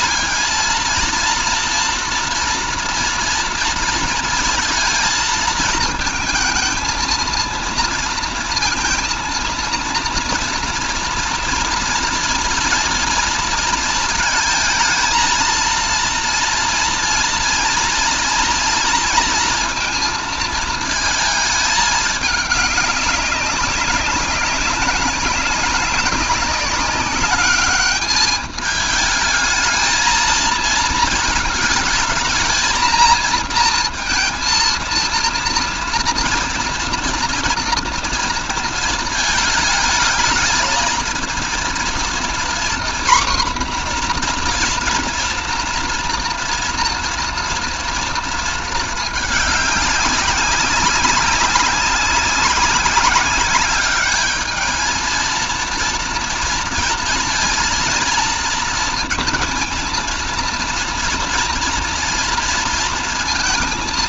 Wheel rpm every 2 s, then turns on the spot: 230, 230, 230, 220, 230, 230, 230, 220, 230, 230, 230, 200, 200, 200, 210, 220, 230, 230, 240, 220, 220, 240, 230, 230, 220, 190, 200, 220, 230, 230, 230, 230.
none